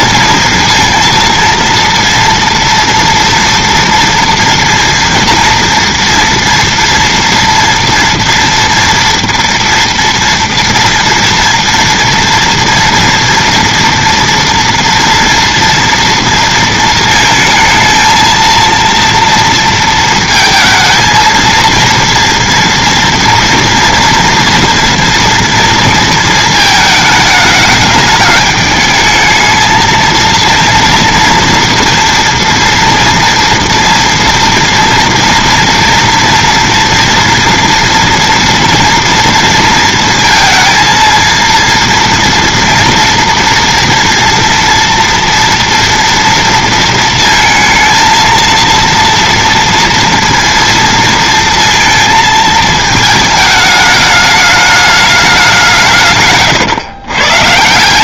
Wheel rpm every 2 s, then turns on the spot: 230, 230, 230, 230, 240, 230, 230, 230, 230, 230, 220, 230, 230, 220, 210, 230, 240, 230, 230, 230, 230, 240, 230, 230, 230, 230, 220, 210, 120.
none